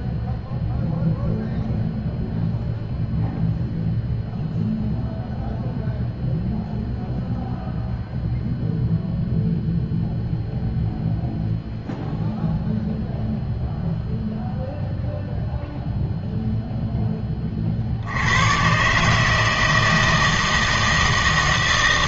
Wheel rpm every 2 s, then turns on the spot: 0, 0, 0, 0, 0, 0, 0, 0, 0, 130, 160.
none